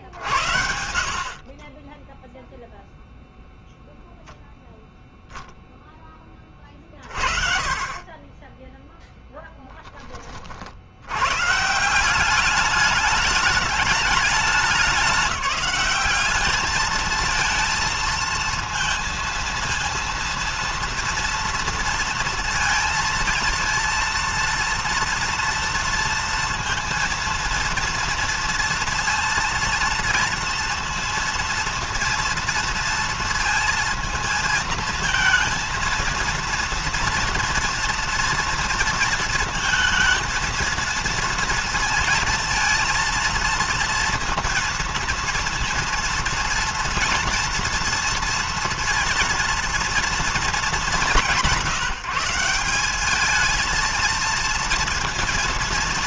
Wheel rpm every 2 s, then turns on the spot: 60, 0, 0, 30, 20, 40, 200, 200, 210, 230, 230, 230, 230, 230, 230, 230, 230, 230, 230, 230, 230, 230, 230, 230, 230, 200, 180, 230.
none